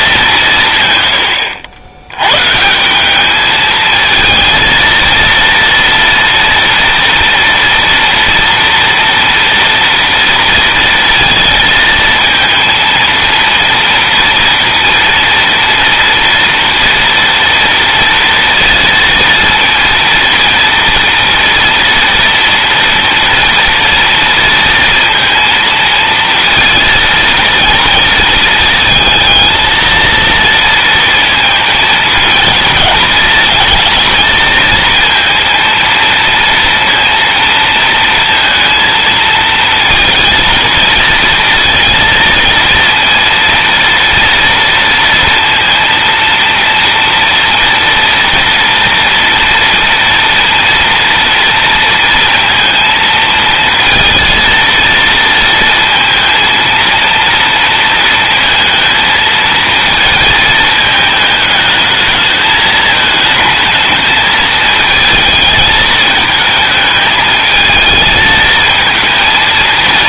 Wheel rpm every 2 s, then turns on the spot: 120, 180, 230, 230, 230, 230, 230, 230, 230, 230, 230, 230, 230, 230, 220, 230, 220, 230, 230, 220, 230, 230, 230, 230, 230, 230, 230, 230, 230, 230, 220, 220, 220, 220, 220.
none